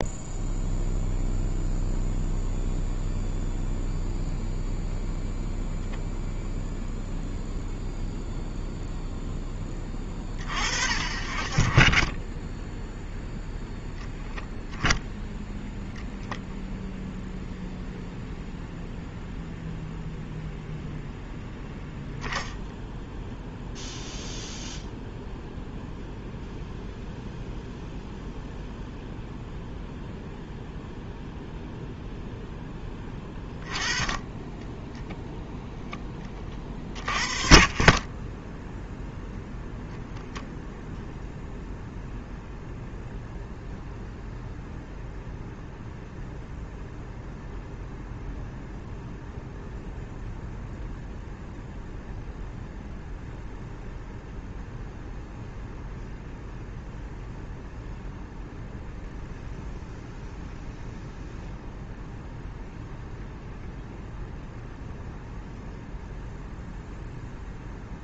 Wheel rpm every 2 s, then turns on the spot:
0, 0, 0, 0, 0, 40, 0, 0, 0, 0, 0, 0, 0, 0, 0, 0, 10, 10, 30, 0, 0, 0, 0, 0, 0, 0, 0, 0, 0, 0, 0, 0, 0, 0.
none